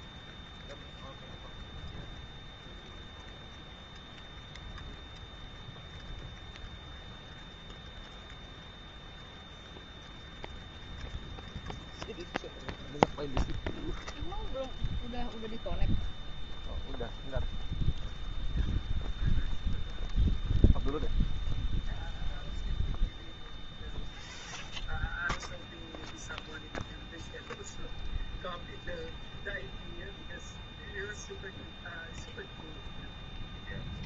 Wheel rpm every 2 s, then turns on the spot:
0, 0, 0, 0, 0, 0, 0, 0, 0, 0, 0, 0, 0, 0, 0, 0, 0.
none